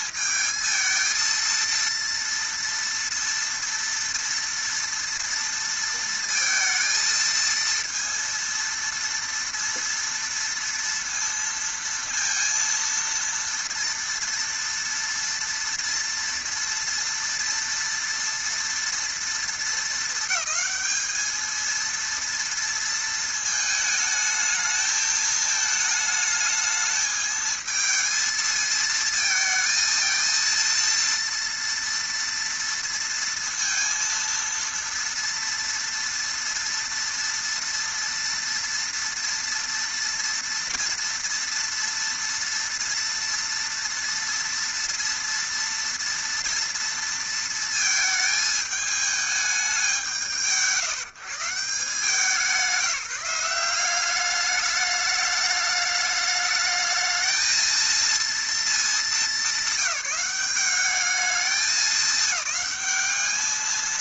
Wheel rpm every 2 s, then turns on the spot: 220, 230, 230, 230, 230, 230, 230, 230, 230, 230, 220, 230, 220, 220, 220, 230, 230, 230, 230, 230, 230, 230, 230, 230, 210, 140, 170, 210, 210, 220, 190, 210.
none